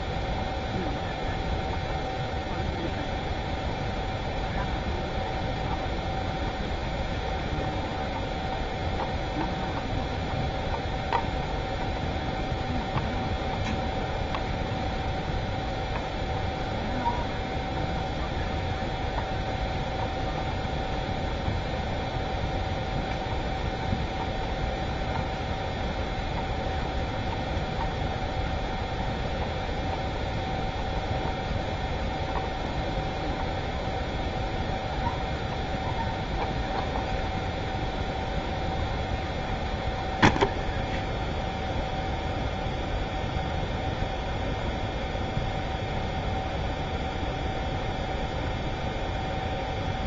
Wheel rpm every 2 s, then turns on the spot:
0, 0, 0, 0, 0, 0, 0, 0, 0, 0, 0, 0, 0, 0, 0, 0, 0, 0, 0, 0, 0, 0, 0, 0, 0.
none